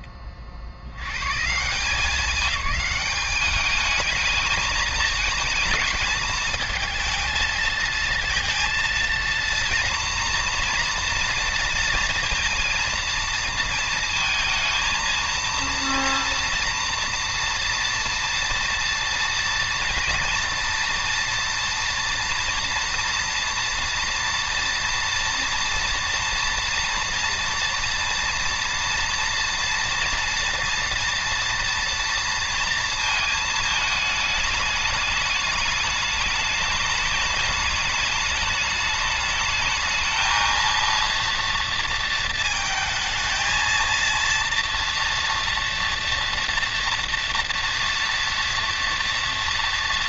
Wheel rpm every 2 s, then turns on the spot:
140, 200, 220, 220, 230, 230, 230, 220, 230, 230, 240, 240, 240, 230, 230, 230, 220, 210, 210, 210, 230, 220, 230, 230, 230.
none